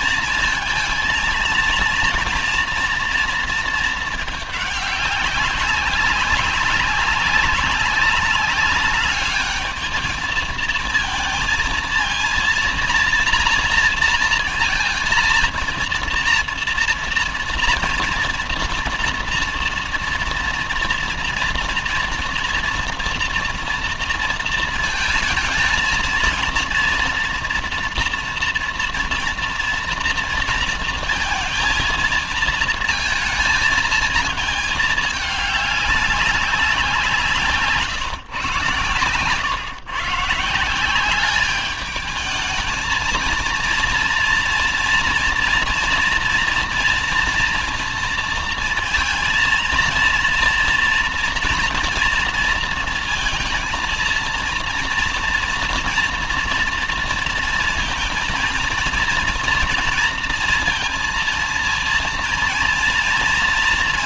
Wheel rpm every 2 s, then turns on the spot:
230, 240, 210, 200, 200, 220, 230, 230, 240, 230, 230, 240, 230, 230, 230, 230, 230, 220, 190, 130, 160, 220, 230, 230, 230, 230, 230, 230, 230, 230, 230, 230.
none